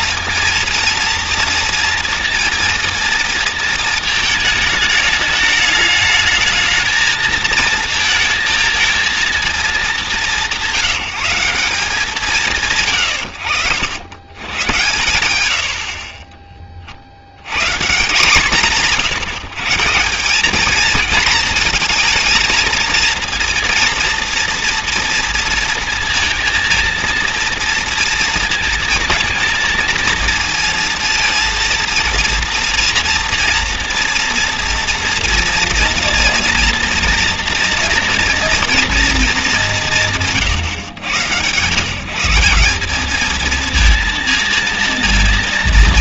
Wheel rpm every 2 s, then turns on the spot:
230, 230, 210, 220, 210, 190, 80, 70, 150, 160, 220, 230, 230, 230, 230, 230, 230, 230, 230, 200, 120, 220, 230.
none